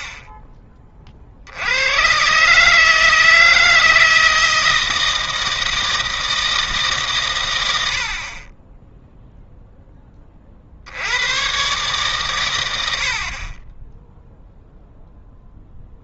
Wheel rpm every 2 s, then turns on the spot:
30, 150, 160, 150, 20, 60, 90, 0.
none